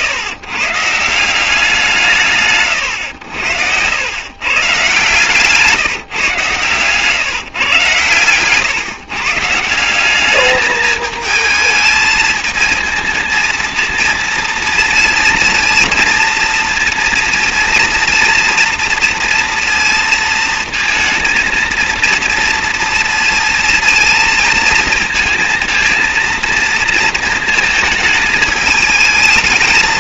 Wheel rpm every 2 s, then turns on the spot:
160, 140, 130, 130, 130, 210, 220, 230, 230, 230, 230, 230, 220, 230, 210.
none